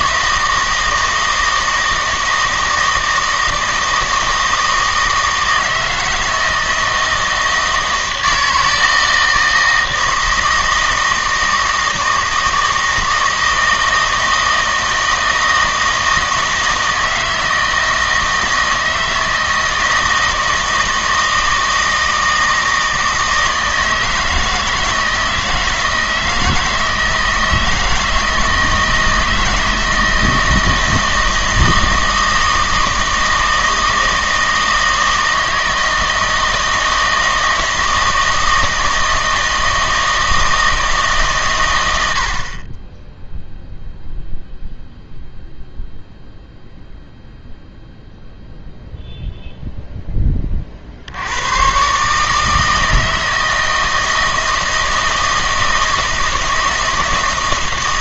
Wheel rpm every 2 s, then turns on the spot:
160, 160, 160, 160, 160, 160, 160, 160, 160, 160, 160, 160, 160, 160, 160, 160, 160, 160, 160, 160, 160, 20, 0, 0, 0, 40, 160, 160, 160.
none